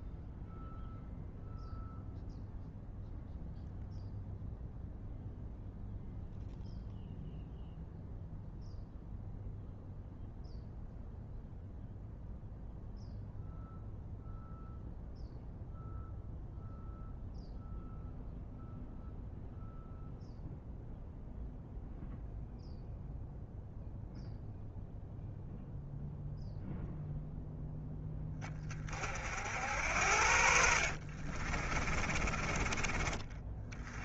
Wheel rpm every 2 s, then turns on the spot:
0, 0, 0, 0, 0, 0, 0, 0, 0, 0, 0, 0, 0, 0, 40, 60, 30.
30-32